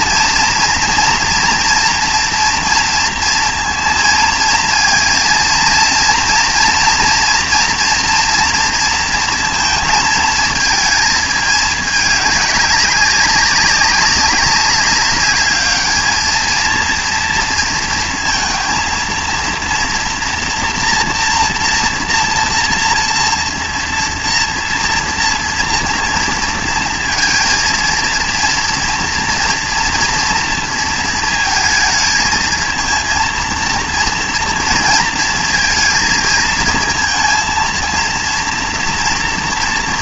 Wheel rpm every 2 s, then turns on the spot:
230, 230, 230, 240, 230, 220, 200, 200, 220, 230, 240, 230, 230, 230, 230, 240, 220, 230, 230, 240.
none